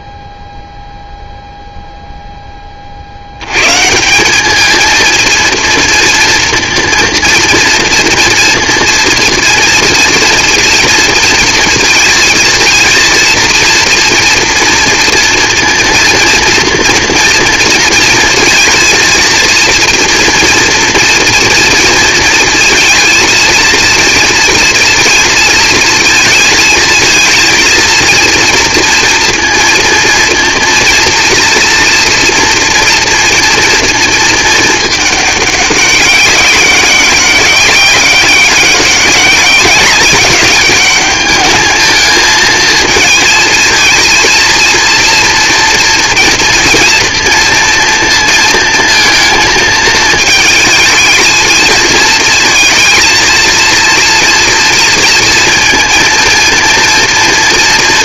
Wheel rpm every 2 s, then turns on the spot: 0, 30, 210, 230, 230, 230, 230, 230, 230, 230, 230, 230, 230, 230, 230, 230, 230, 220, 190, 200, 200, 220, 230, 230, 230, 220, 230, 230, 230.
none